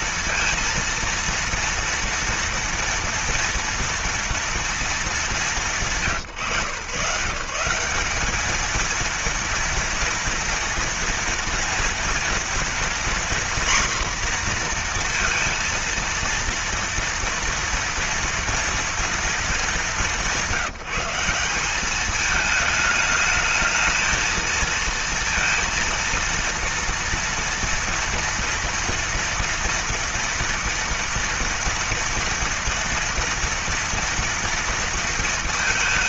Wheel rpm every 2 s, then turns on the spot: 230, 230, 220, 130, 230, 230, 240, 240, 230, 230, 180, 210, 230, 230, 230, 230, 230, 230.
none